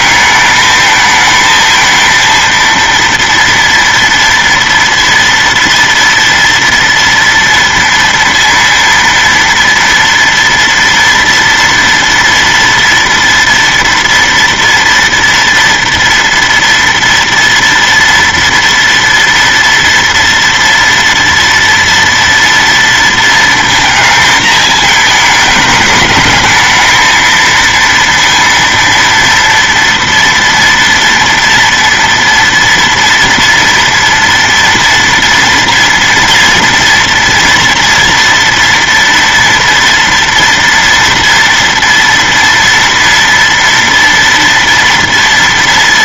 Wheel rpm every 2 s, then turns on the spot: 220, 230, 230, 230, 230, 230, 230, 230, 230, 230, 230, 230, 220, 220, 230, 230, 230, 230, 240, 230, 240, 230, 230.
none